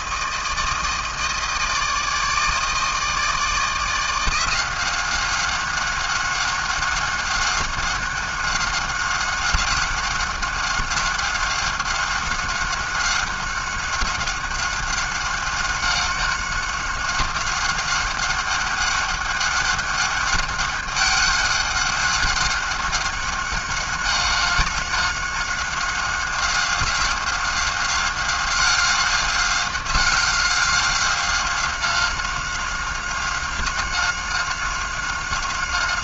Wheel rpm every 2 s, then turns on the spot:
160, 160, 170, 190, 190, 190, 190, 190, 190, 190, 200, 200, 190, 190, 190, 190, 190, 190.
none